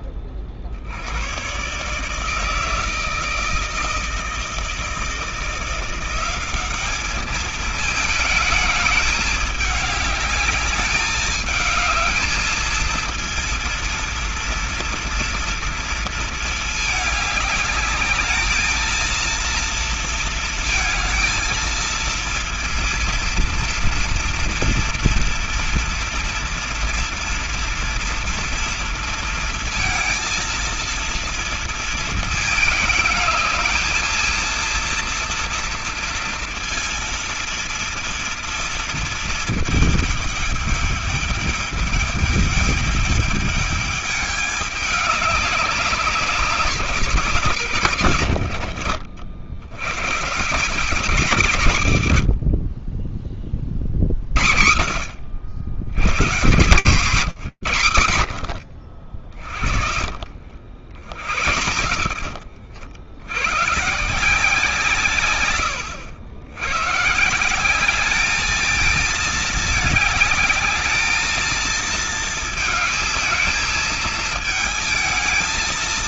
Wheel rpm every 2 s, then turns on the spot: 70, 160, 160, 200, 220, 210, 220, 230, 210, 220, 230, 230, 230, 230, 230, 230, 220, 230, 230, 230, 210, 210, 210, 190, 90, 170, 50, 80, 190, 50, 70, 90, 160, 140, 220, 220, 220, 220.
none